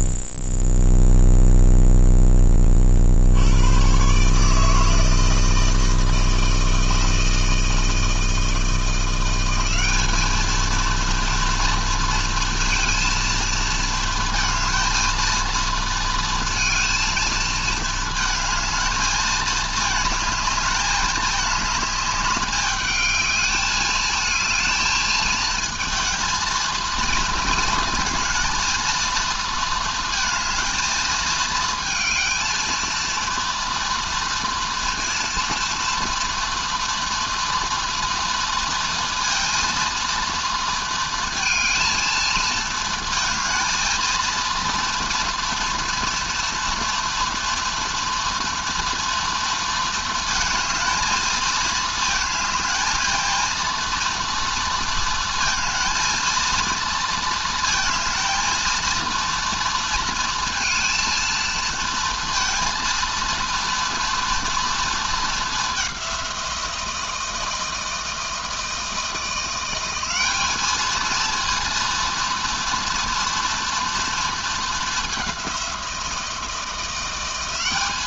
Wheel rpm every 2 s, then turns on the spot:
0, 60, 160, 160, 170, 230, 230, 220, 230, 220, 210, 210, 220, 220, 230, 220, 230, 230, 240, 230, 230, 220, 230, 230, 230, 220, 220, 230, 230, 230, 230, 230, 230, 170, 170, 220, 230, 210, 170.
none